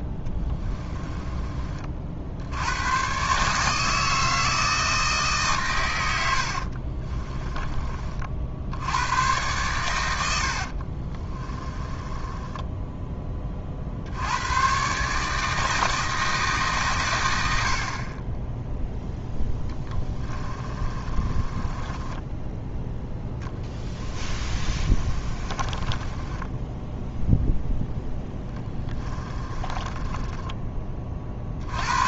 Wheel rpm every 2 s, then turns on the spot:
30, 100, 160, 60, 70, 60, 10, 130, 150, 10, 20, 10, 30, 10, 10, 20.
0-2 6-8 10-14 20-22 24-30